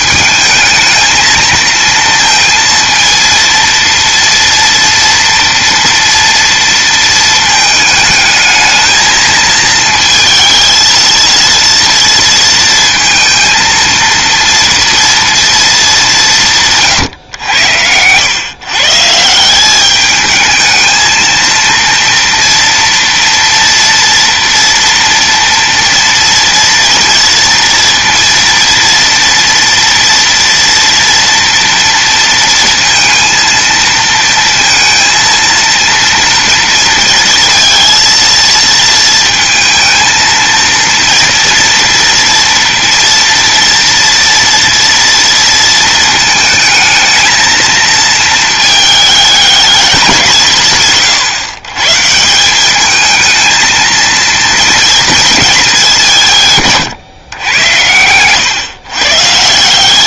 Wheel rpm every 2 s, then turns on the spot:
220, 230, 230, 230, 220, 230, 230, 230, 120, 160, 220, 230, 230, 230, 230, 230, 230, 230, 230, 220, 230, 230, 230, 220, 220, 150, 220, 220, 120, 140.
none